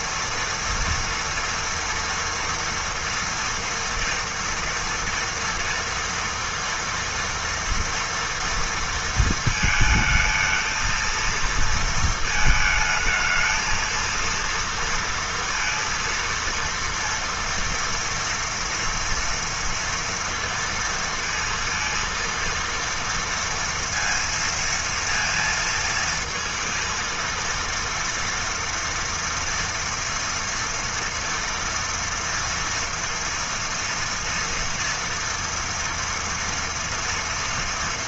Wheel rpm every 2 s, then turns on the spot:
230, 230, 230, 230, 230, 230, 220, 230, 230, 230, 230, 230, 230, 230, 230, 230, 230, 230, 230.
none